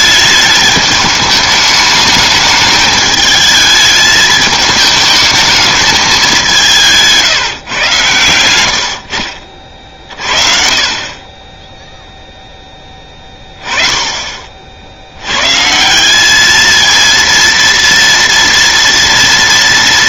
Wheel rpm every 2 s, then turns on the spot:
210, 210, 220, 190, 90, 40, 10, 40, 220, 230.
none